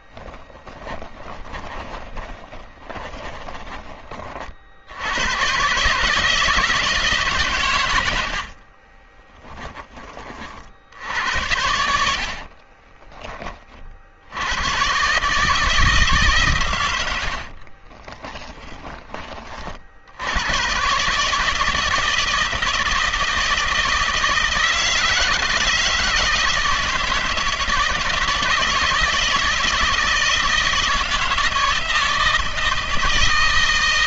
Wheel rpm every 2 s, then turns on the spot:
20, 20, 30, 160, 70, 40, 50, 70, 140, 30, 90, 160, 160, 150, 150, 160, 160.
0-4 8-10 12-14 18-20